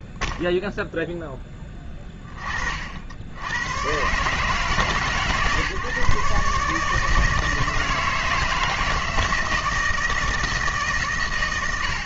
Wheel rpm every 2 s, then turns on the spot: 0, 40, 150, 150, 160, 160.
none